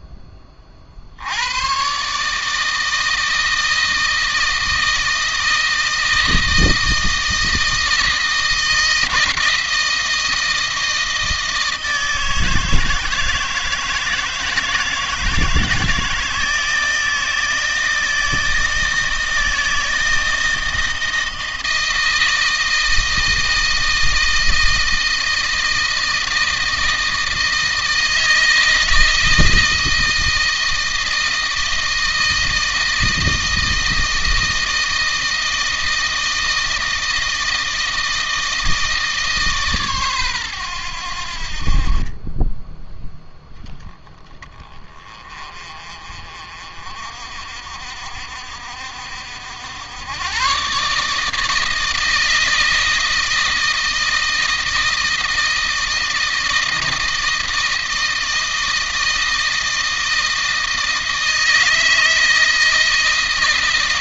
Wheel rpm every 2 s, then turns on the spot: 40, 150, 160, 160, 160, 160, 160, 160, 160, 160, 160, 160, 160, 160, 160, 160, 160, 160, 160, 160, 110, 10, 20, 50, 60, 130, 160, 160, 160, 160, 160, 160.
none